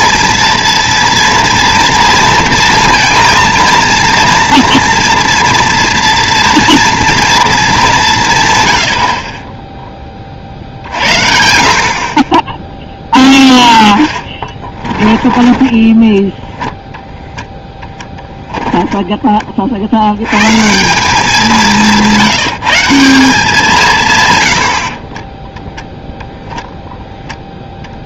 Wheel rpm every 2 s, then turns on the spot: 230, 230, 230, 230, 110, 50, 10, 20, 10, 10, 140, 170, 90, 0.
14-16